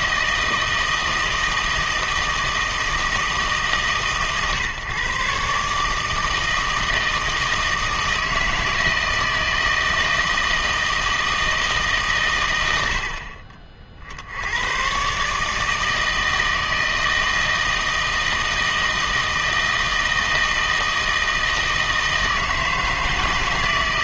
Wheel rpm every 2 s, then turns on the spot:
160, 160, 140, 160, 160, 160, 100, 100, 160, 160, 160, 160.
none